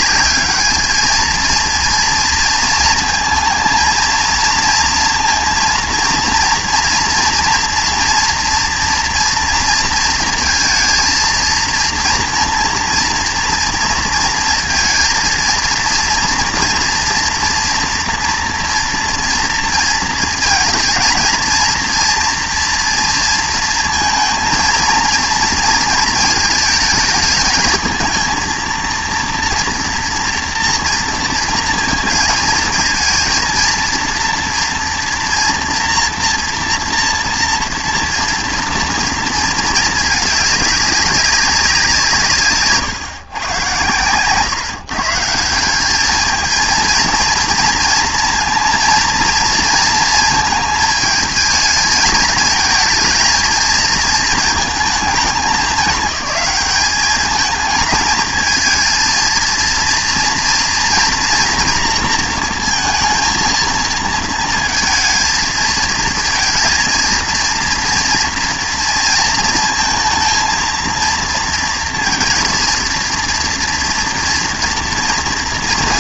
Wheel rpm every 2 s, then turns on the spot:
210, 230, 230, 230, 240, 230, 240, 230, 230, 230, 230, 230, 230, 220, 230, 240, 230, 240, 240, 230, 200, 150, 140, 220, 230, 220, 220, 220, 200, 220, 230, 230, 230, 230, 230, 230, 230, 230.
42-44